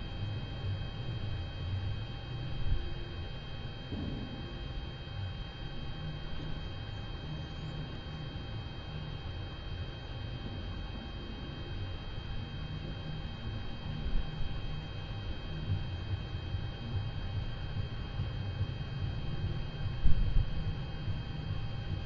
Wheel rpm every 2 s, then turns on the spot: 0, 0, 0, 0, 0, 0, 0, 0, 0, 0, 0.
none